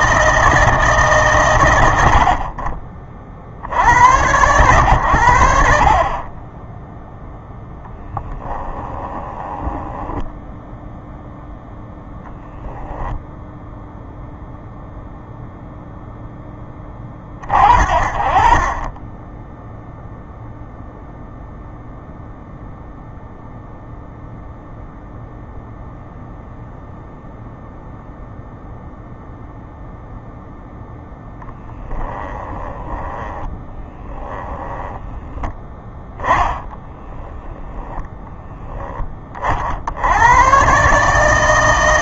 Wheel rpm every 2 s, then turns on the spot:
150, 40, 110, 0, 10, 0, 10, 0, 20, 20, 0, 0, 0, 0, 0, 10, 10, 10, 20, 20, 140.
8-10 12-14 32-38